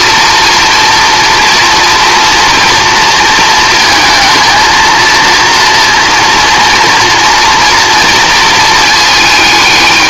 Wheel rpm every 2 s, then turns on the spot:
230, 230, 220, 230, 220.
none